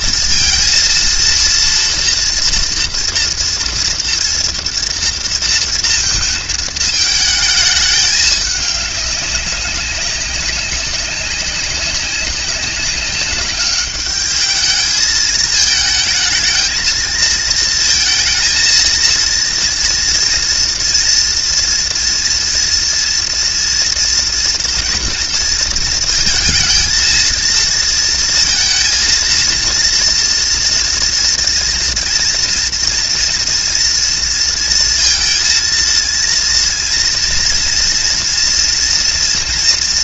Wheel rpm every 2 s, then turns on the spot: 230, 240, 230, 220, 210, 190, 200, 210, 220, 230, 230, 230, 240, 230, 230, 230, 230, 230, 230, 240.
none